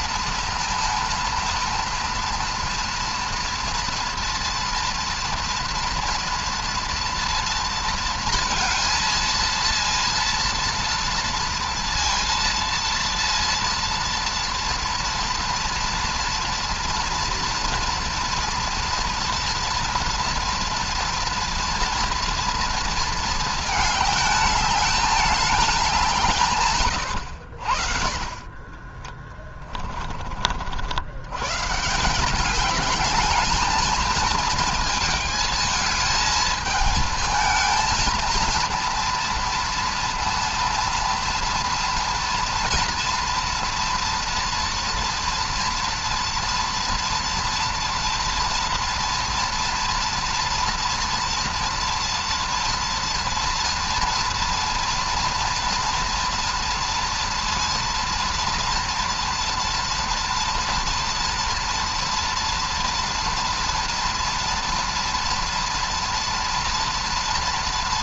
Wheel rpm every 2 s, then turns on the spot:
230, 230, 230, 230, 220, 230, 230, 230, 230, 230, 230, 230, 220, 110, 20, 100, 210, 220, 220, 230, 230, 240, 230, 230, 230, 230, 240, 230, 230, 230, 230, 230, 230, 230.
28-30